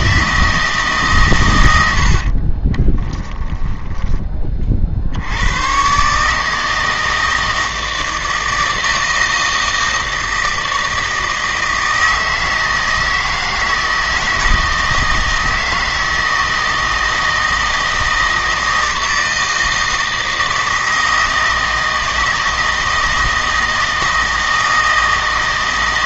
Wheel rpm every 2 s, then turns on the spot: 160, 30, 50, 160, 160, 160, 160, 160, 160, 160, 160, 160, 160.
2-4